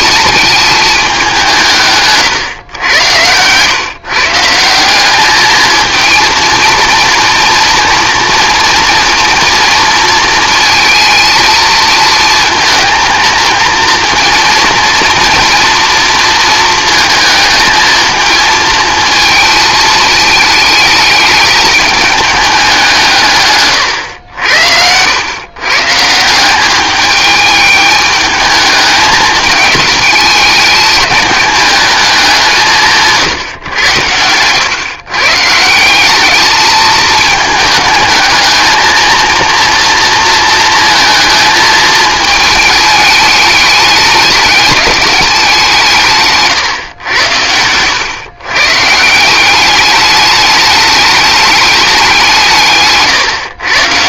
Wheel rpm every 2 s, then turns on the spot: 220, 120, 180, 230, 230, 230, 230, 230, 220, 230, 220, 190, 90, 200, 210, 220, 170, 120, 220, 230, 230, 210, 200, 130, 140, 210, 150.
none